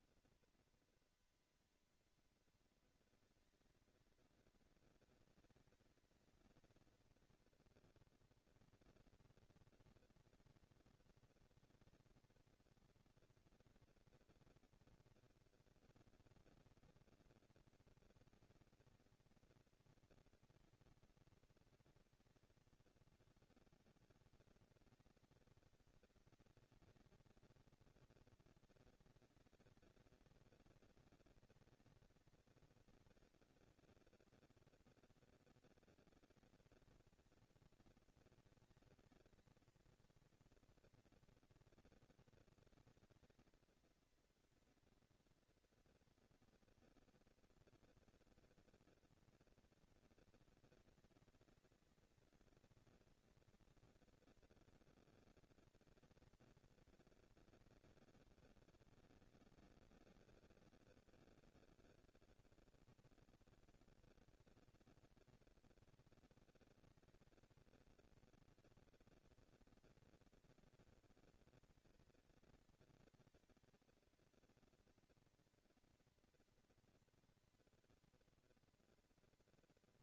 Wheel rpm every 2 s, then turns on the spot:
230, 230, 230, 220, 230, 230, 230, 240, 230, 230, 230, 210, 200, 200, 220, 230, 230, 230, 230, 220, 230, 220, 230, 230, 230, 230, 230, 230, 230, 210, 200, 210, 230, 230, 230, 230, 230, 230, 230, 230.
none